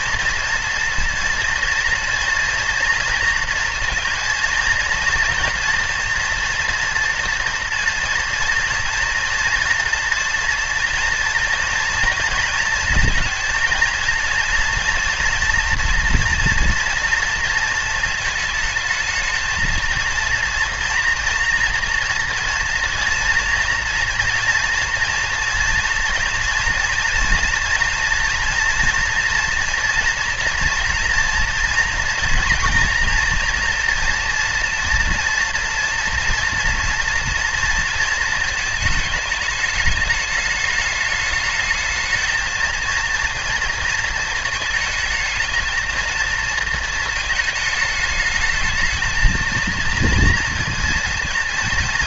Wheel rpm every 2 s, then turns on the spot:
230, 230, 230, 240, 230, 240, 230, 230, 230, 220, 230, 230, 240, 240, 240, 230, 240, 230, 230, 220, 210, 230, 220, 230, 220, 230.
none